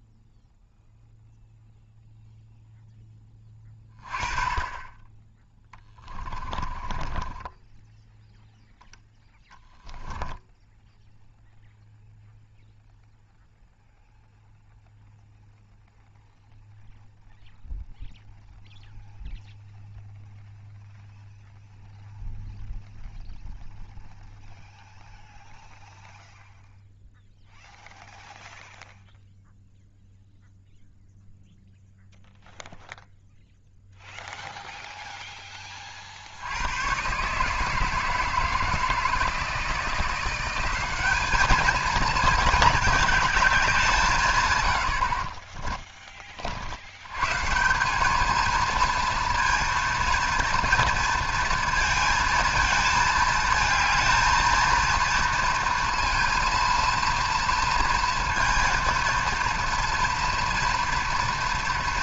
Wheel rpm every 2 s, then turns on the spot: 0, 0, 20, 20, 0, 0, 0, 0, 0, 0, 0, 0, 0, 0, 0, 0, 0, 0, 90, 160, 190, 220, 100, 60, 230, 230, 220, 230, 230, 230, 230.
6-8